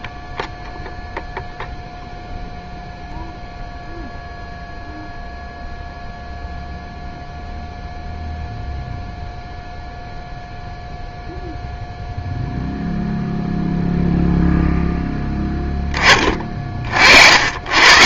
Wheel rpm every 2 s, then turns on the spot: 0, 0, 0, 0, 0, 0, 0, 0, 40.
none